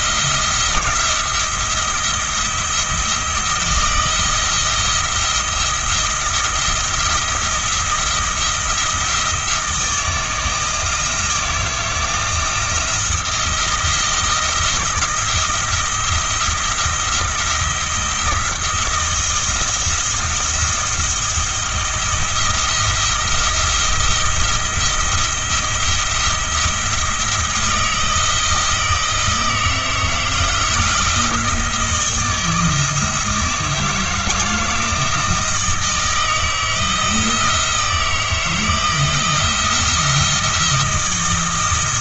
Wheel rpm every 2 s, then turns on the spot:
170, 170, 170, 170, 170, 160, 170, 170, 170, 170, 170, 170, 170, 170, 160, 170, 160, 160, 160, 160, 170.
none